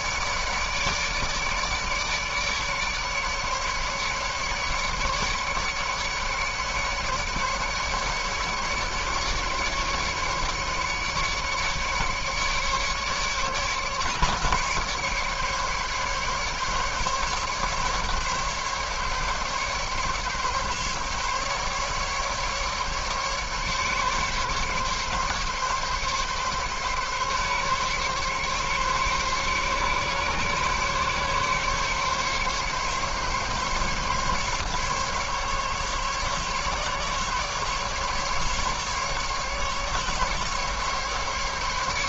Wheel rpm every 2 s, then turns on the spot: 150, 150, 150, 150, 140, 140, 150, 140, 140, 140, 140, 150, 140, 140, 140, 140, 140, 140, 140, 140, 150.
none